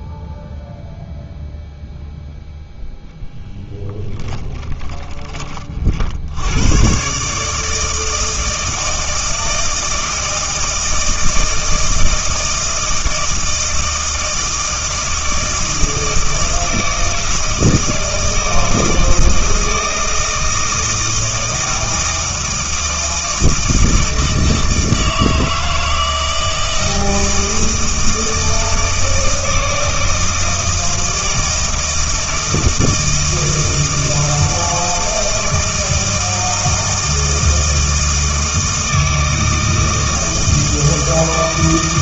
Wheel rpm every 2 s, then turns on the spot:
0, 0, 10, 120, 160, 160, 160, 160, 160, 160, 160, 160, 160, 160, 160, 160, 160, 160, 160, 160, 160.
4-6